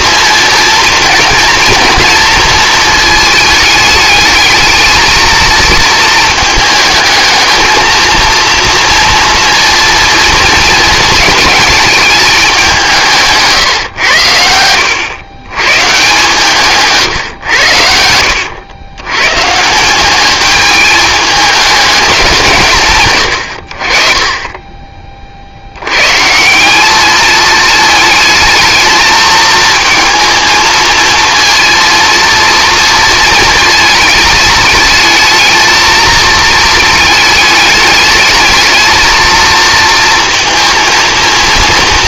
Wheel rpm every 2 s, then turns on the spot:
240, 220, 220, 220, 230, 230, 170, 100, 150, 110, 220, 150, 20, 190, 220, 220, 230, 220, 220, 220, 230.
none